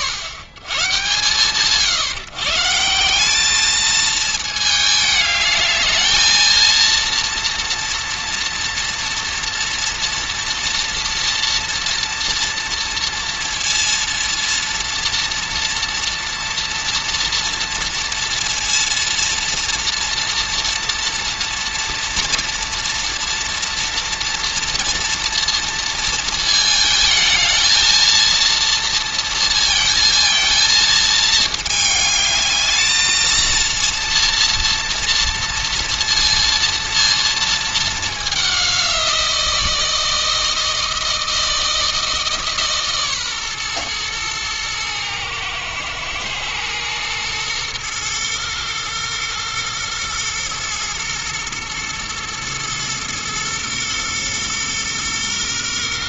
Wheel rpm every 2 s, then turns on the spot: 70, 160, 220, 230, 230, 230, 230, 230, 230, 230, 230, 230, 230, 220, 230, 230, 220, 230, 230, 190, 160, 150, 110, 120, 120, 120, 120, 120.
none